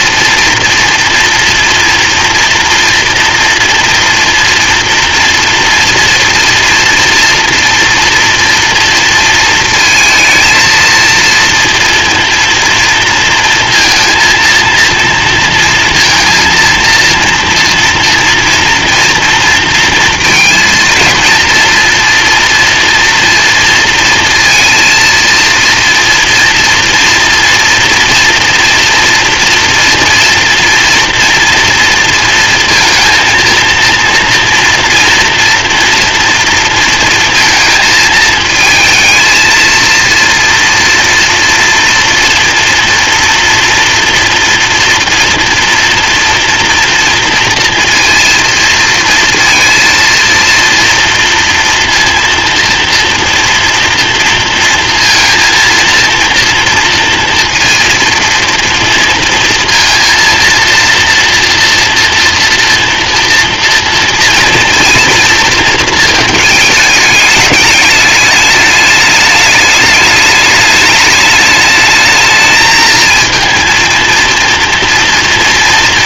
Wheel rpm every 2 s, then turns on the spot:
230, 240, 230, 230, 230, 230, 240, 230, 230, 230, 230, 240, 230, 230, 230, 230, 230, 230, 230, 220, 230, 230, 230, 240, 230, 230, 230, 230, 230, 230, 230, 230, 230, 210, 210, 210, 220, 230.
none